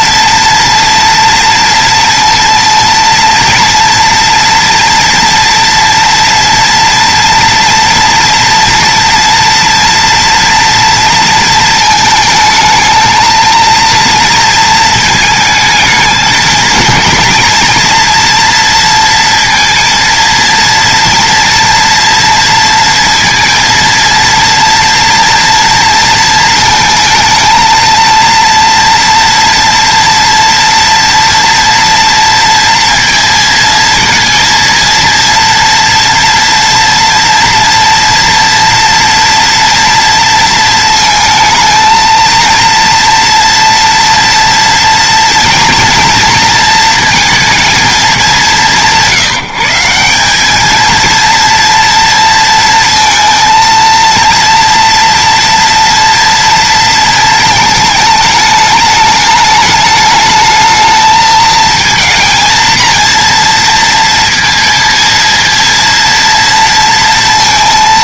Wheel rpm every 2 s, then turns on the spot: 230, 230, 240, 230, 230, 230, 220, 230, 230, 230, 230, 230, 230, 220, 230, 230, 230, 230, 230, 230, 230, 230, 230, 230, 180, 230, 230, 230, 230, 210, 220, 230, 230, 230.
none